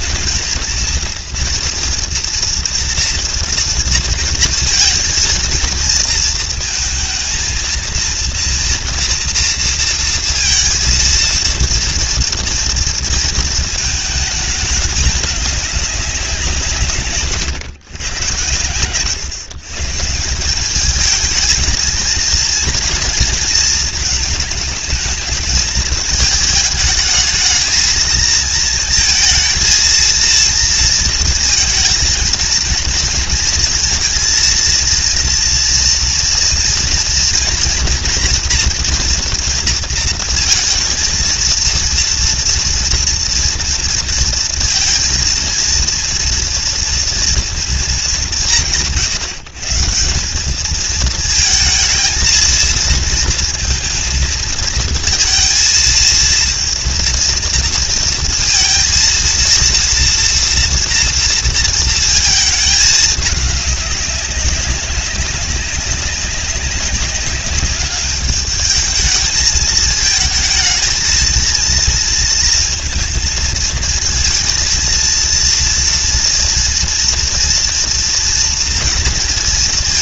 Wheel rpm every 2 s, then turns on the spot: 220, 230, 230, 230, 230, 230, 230, 210, 160, 110, 200, 230, 220, 220, 220, 230, 230, 230, 230, 240, 220, 230, 230, 230, 130, 210, 230, 220, 230, 230, 230, 220, 190, 200, 210, 220, 230, 230, 230, 230.
none